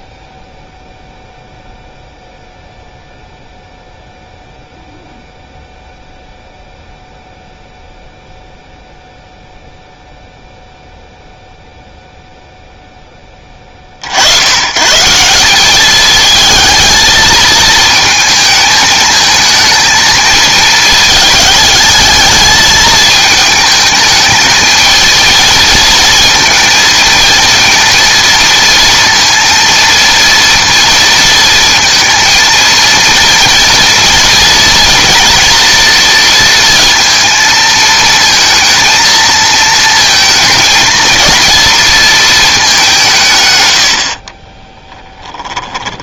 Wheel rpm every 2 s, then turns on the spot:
0, 0, 0, 0, 0, 0, 0, 130, 220, 220, 220, 220, 220, 220, 230, 230, 230, 230, 230, 230, 220, 200, 20.
44-46